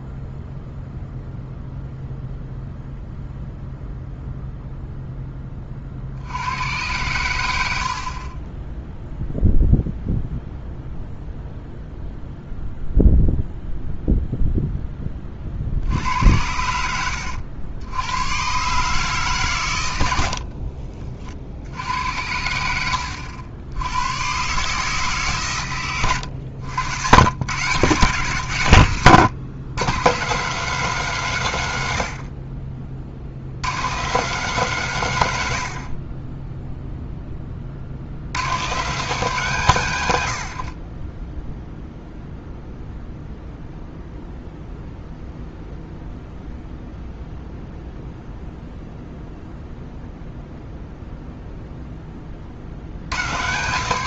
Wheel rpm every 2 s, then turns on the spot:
0, 0, 0, 100, 0, 0, 0, 10, 90, 140, 30, 80, 140, 100, 110, 180, 40, 160, 0, 150, 40, 0, 0, 0, 0, 0, 90.
40-42